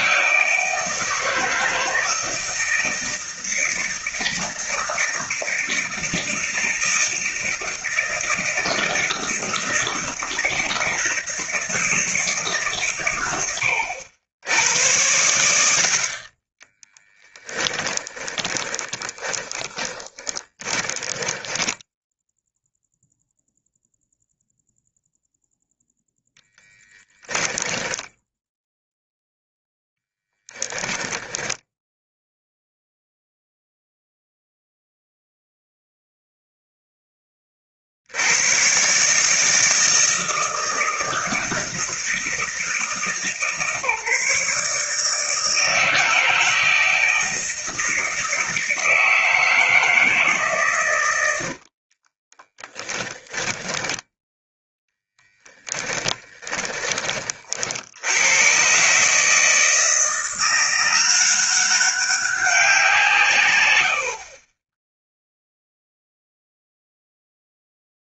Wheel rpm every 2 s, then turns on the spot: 160, 160, 160, 160, 160, 160, 120, 90, 10, 20, 20, 0, 0, 10, 0, 10, 0, 0, 10, 140, 160, 160, 160, 160, 160, 100, 10, 20, 30, 140, 180, 160, 0, 0.
16-22 26-28 30-32 52-56